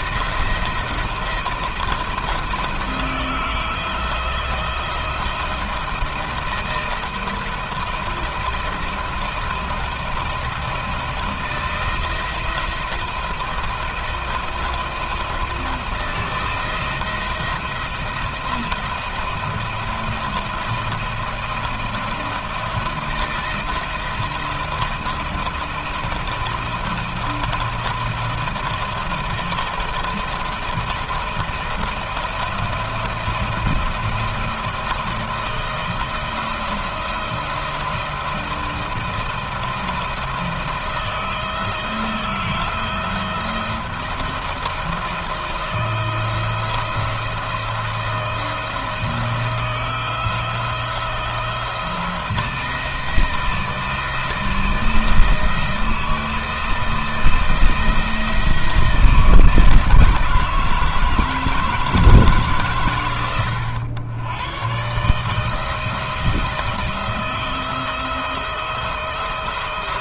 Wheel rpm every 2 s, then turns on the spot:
170, 170, 160, 170, 170, 170, 170, 170, 170, 170, 170, 170, 160, 170, 170, 170, 170, 170, 170, 170, 170, 160, 170, 160, 160, 170, 170, 170, 170, 160, 160, 140, 120, 170, 170.
none